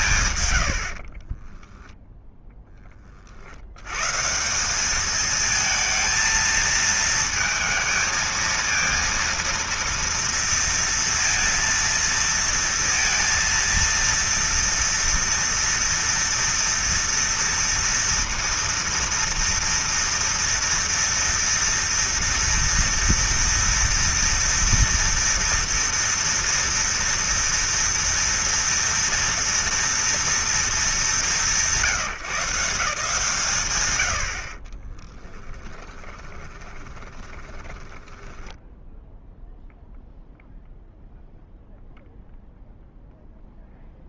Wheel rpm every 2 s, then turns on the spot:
60, 30, 200, 230, 230, 230, 230, 230, 230, 230, 230, 230, 240, 230, 230, 220, 160, 20, 20, 10, 0, 0.
0-2 34-38